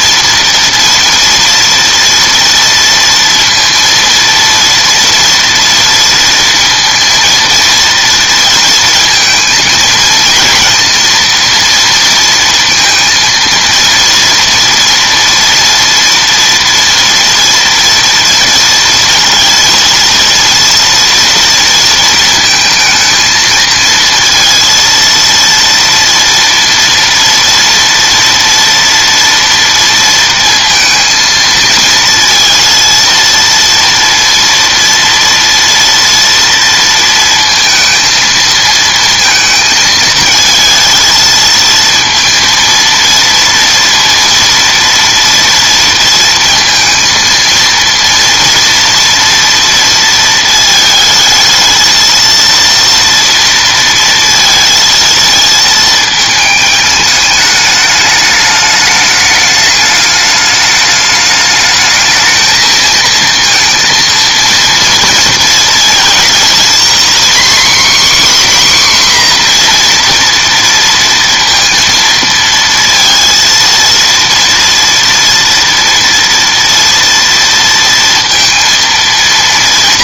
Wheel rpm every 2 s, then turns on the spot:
230, 230, 230, 230, 230, 230, 230, 230, 230, 230, 230, 220, 230, 230, 230, 230, 230, 230, 230, 230, 220, 230, 230, 230, 230, 220, 230, 230, 210, 210, 210, 230, 230, 250, 260, 230, 230, 230, 230, 230.
none